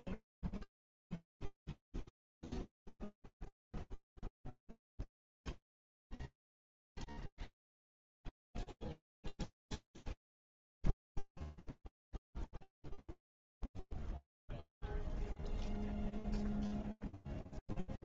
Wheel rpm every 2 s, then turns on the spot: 0, 0, 0, 0, 0, 0, 0, 0, 0.
none